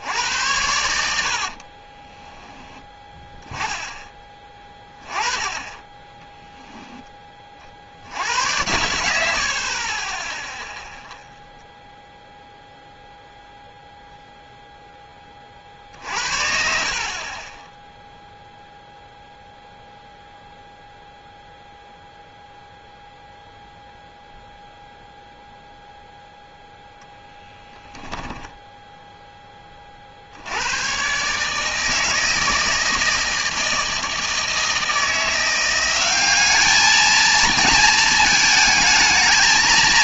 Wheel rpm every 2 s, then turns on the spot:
80, 10, 20, 10, 80, 0, 0, 0, 40, 0, 0, 0, 0, 0, 10, 80, 160, 160, 210, 220.
28-30